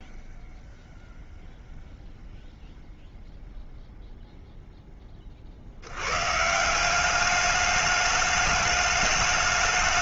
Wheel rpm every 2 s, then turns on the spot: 0, 0, 0, 150, 210.
none